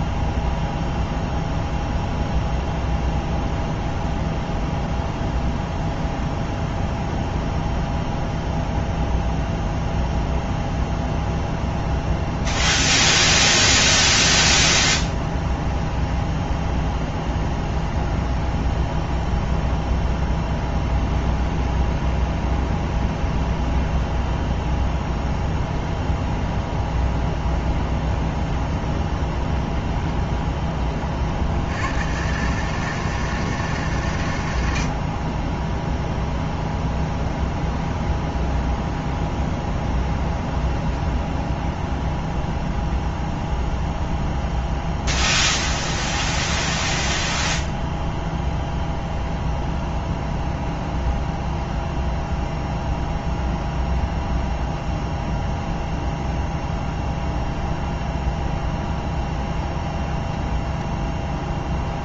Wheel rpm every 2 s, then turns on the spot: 0, 0, 0, 0, 0, 0, 0, 20, 20, 10, 20, 20, 0, 0, 0, 30, 150, 40, 0, 0, 0, 0, 0, 0, 0, 0, 0, 0, 0, 10, 0.
14-24